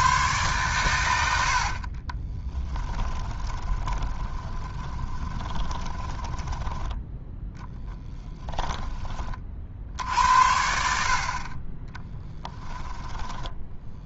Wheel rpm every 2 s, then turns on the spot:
120, 10, 20, 10, 20, 60, 10.
2-10 12-14